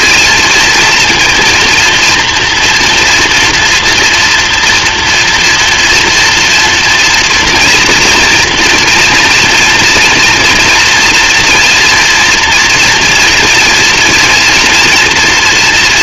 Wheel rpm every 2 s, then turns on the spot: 230, 240, 240, 230, 230, 230, 230, 230.
none